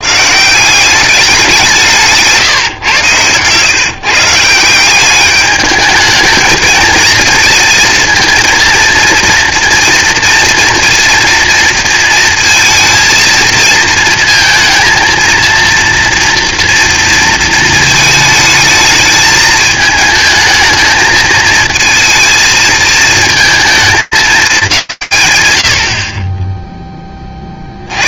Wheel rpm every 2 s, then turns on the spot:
190, 130, 180, 220, 230, 230, 230, 230, 230, 210, 220, 220, 210, 40.
none